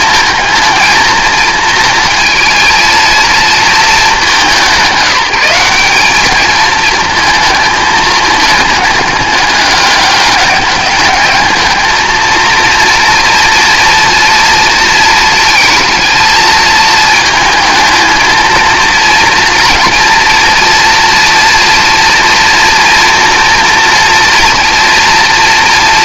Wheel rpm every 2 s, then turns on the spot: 230, 220, 190, 220, 210, 200, 230, 230, 220, 230, 230, 240, 230.
none